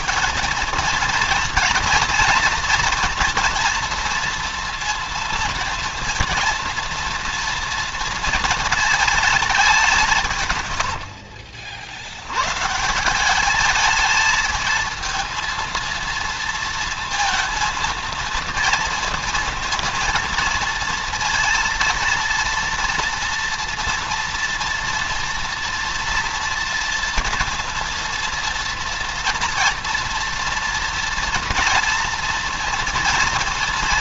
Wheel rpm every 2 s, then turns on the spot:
220, 230, 230, 230, 220, 90, 150, 230, 230, 230, 230, 230, 240, 230, 230, 230, 230.
none